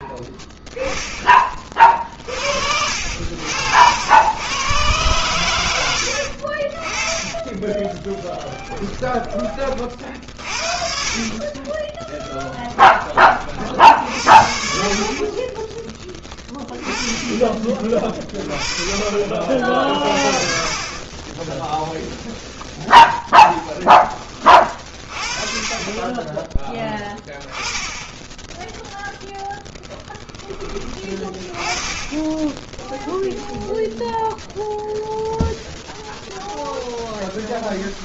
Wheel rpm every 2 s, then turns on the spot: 10, 60, 120, 40, 10, 50, 10, 50, 20, 30, 40, 0, 30, 10, 0, 20, 10, 0, 0.
8-12 32-34